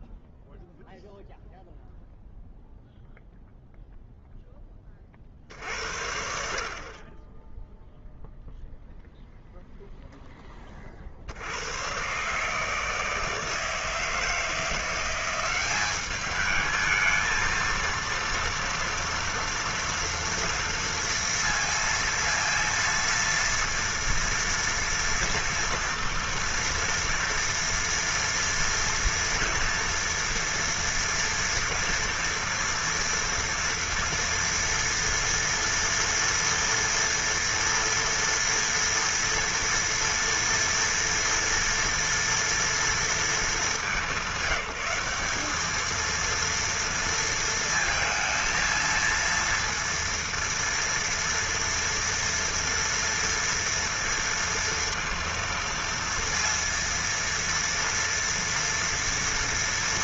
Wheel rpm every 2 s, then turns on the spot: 0, 0, 60, 10, 0, 70, 160, 190, 230, 230, 230, 230, 240, 230, 230, 230, 230, 240, 230, 230, 230, 230, 190, 230, 230, 230, 230, 230, 230, 230.
none